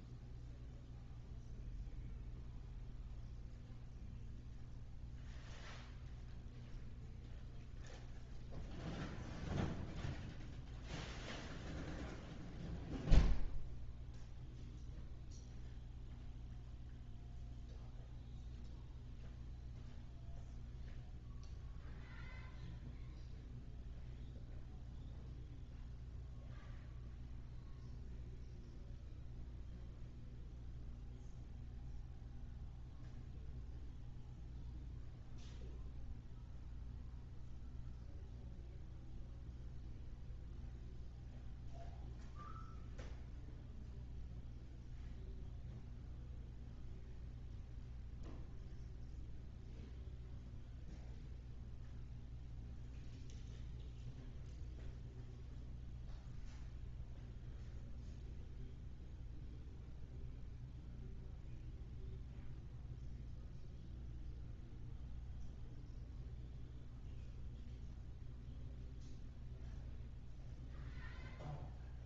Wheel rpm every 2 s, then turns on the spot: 0, 0, 0, 0, 0, 0, 0, 0, 0, 0, 0, 0, 0, 0, 0, 0, 0, 0, 0, 0, 0, 0, 0, 0, 0, 0, 0, 0, 0, 0, 0, 0, 0, 0, 0, 0.
none